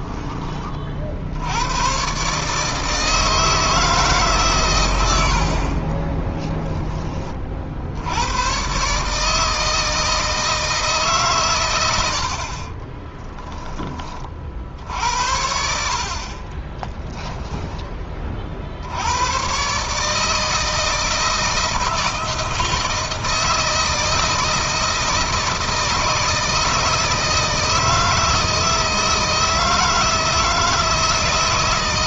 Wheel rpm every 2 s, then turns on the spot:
30, 150, 130, 10, 120, 160, 40, 60, 20, 60, 160, 160, 160, 160, 160, 160.
12-14 16-18